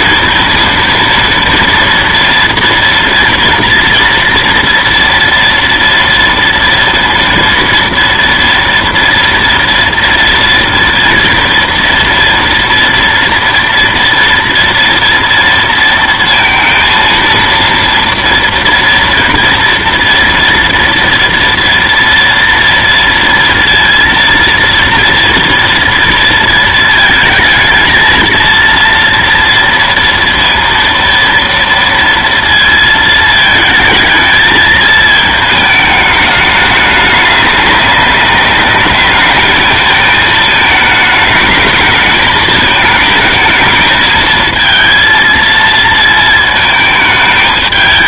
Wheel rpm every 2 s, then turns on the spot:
230, 230, 230, 230, 230, 230, 230, 230, 230, 230, 230, 230, 230, 230, 230, 230, 230, 220, 210, 200, 220, 220, 220, 220.
none